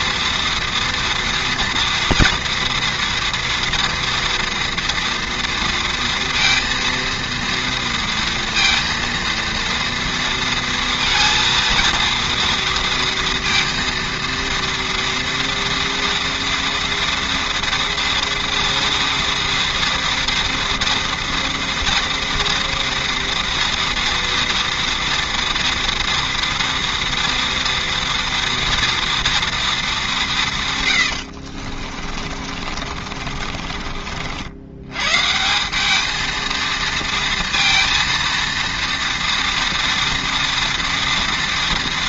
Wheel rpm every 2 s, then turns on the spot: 230, 240, 230, 230, 230, 230, 230, 230, 230, 230, 240, 230, 240, 230, 230, 150, 50, 90, 230, 230, 230.
32-34